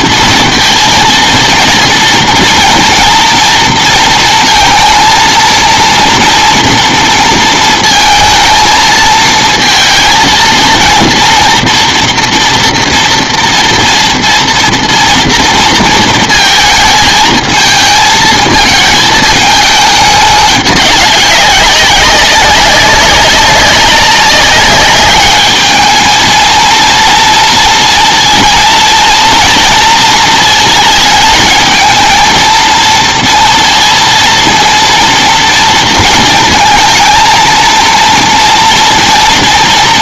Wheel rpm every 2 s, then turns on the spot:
230, 240, 230, 230, 230, 230, 230, 230, 220, 220, 200, 190, 200, 230, 230, 220, 230, 230, 230, 230.
none